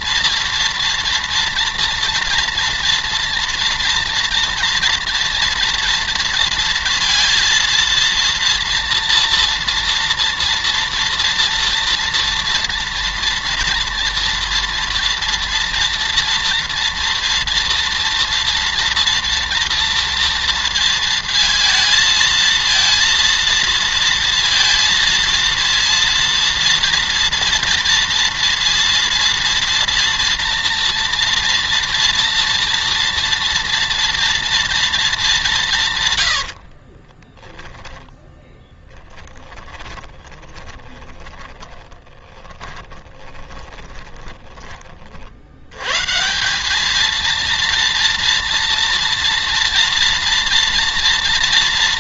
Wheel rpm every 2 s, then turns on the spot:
230, 230, 230, 230, 230, 230, 230, 230, 230, 230, 230, 230, 230, 230, 230, 240, 230, 230, 60, 10, 40, 20, 30, 210, 230, 240.
36-44